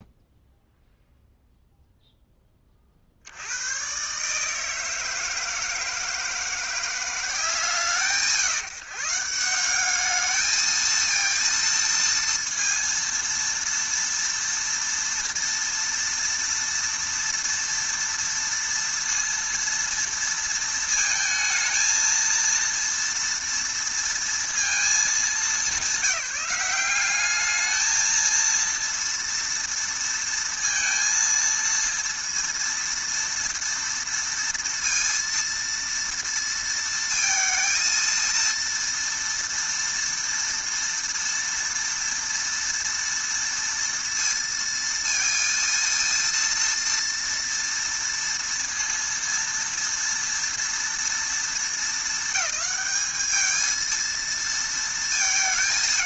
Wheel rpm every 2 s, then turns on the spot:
0, 40, 160, 170, 150, 220, 230, 230, 230, 230, 220, 230, 220, 190, 230, 230, 230, 230, 230, 230, 230, 230, 230, 230, 230, 230, 210, 230.
none